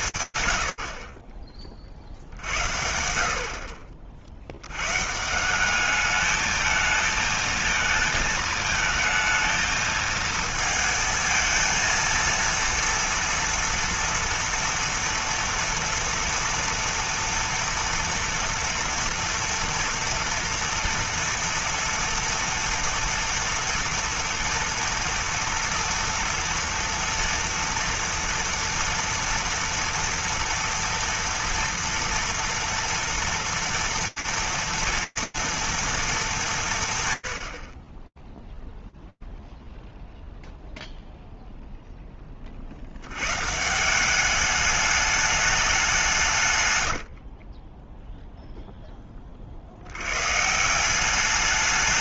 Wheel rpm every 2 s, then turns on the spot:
120, 60, 70, 220, 220, 230, 230, 230, 230, 230, 230, 230, 230, 230, 230, 240, 230, 230, 60, 0, 0, 160, 200, 20, 60, 210.
46-48